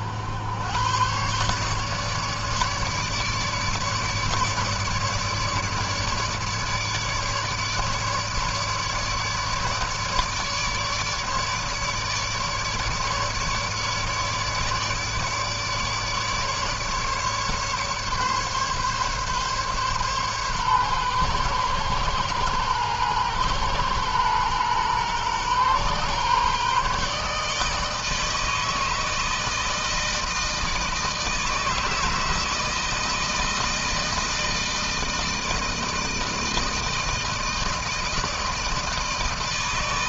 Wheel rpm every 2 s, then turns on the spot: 100, 150, 150, 150, 150, 150, 150, 150, 150, 140, 130, 120, 120, 140, 160, 160, 160, 160, 160, 160.
none